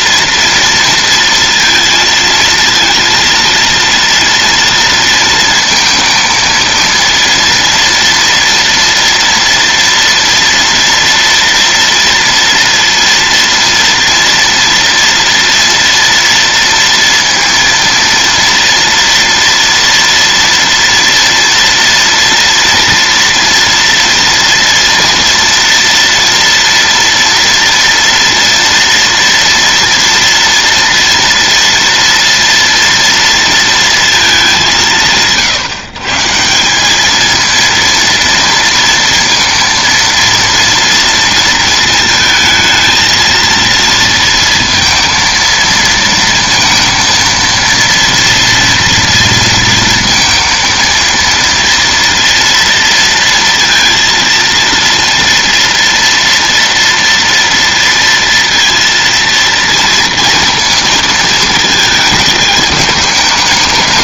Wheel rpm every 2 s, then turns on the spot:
230, 230, 230, 230, 230, 230, 230, 230, 230, 230, 230, 230, 230, 230, 230, 230, 230, 180, 190, 230, 230, 220, 230, 230, 230, 230, 230, 230, 230, 230, 230, 210.
none